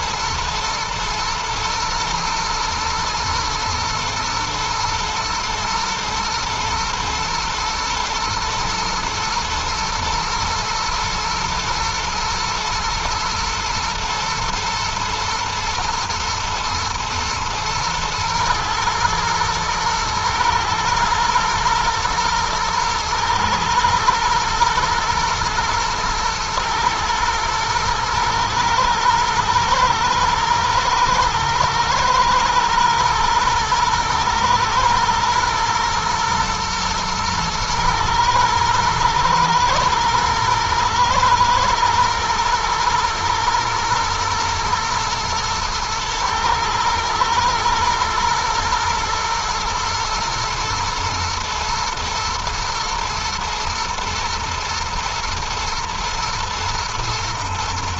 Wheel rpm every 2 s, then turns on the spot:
120, 120, 110, 120, 110, 110, 120, 110, 110, 110, 110, 110, 110, 110, 110, 110, 110, 110, 120, 110, 110, 120, 120, 110, 110, 120, 110, 110, 120.
none